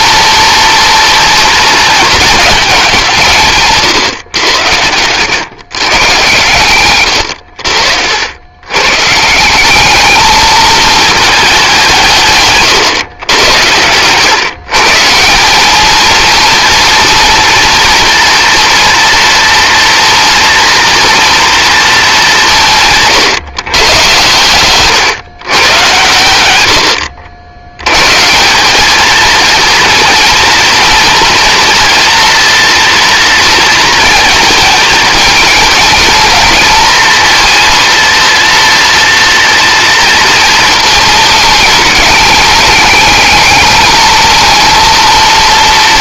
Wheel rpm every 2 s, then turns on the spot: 230, 200, 100, 110, 120, 220, 120, 150, 230, 230, 240, 160, 130, 90, 210, 230, 240, 220, 230, 230, 220, 210, 230.
none